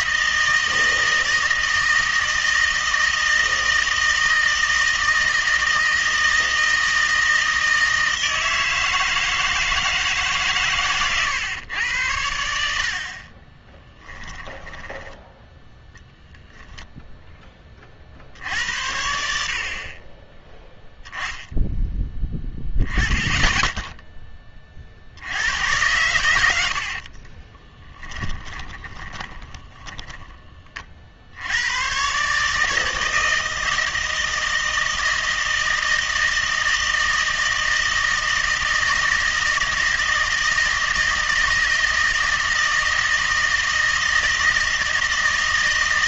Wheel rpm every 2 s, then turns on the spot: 160, 160, 160, 160, 160, 130, 70, 10, 0, 80, 10, 10, 30, 80, 20, 30, 150, 160, 160, 160, 160, 160, 160.
14-16 26-30